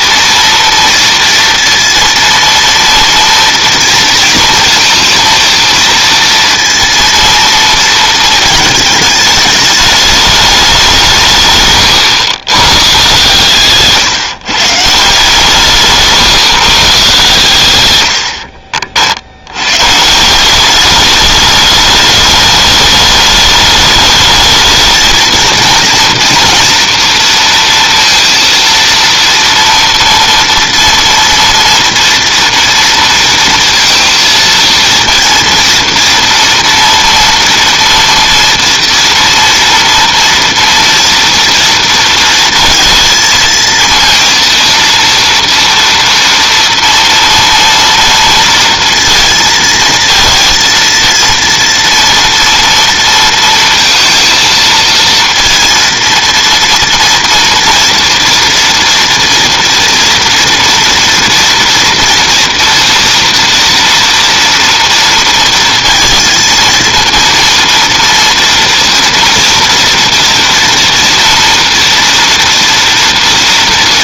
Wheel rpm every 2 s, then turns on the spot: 230, 230, 230, 230, 220, 200, 130, 150, 140, 40, 200, 210, 220, 240, 230, 230, 230, 230, 230, 230, 230, 230, 230, 230, 230, 230, 230, 220, 230, 230, 230, 230, 230, 230, 230, 230, 230.
none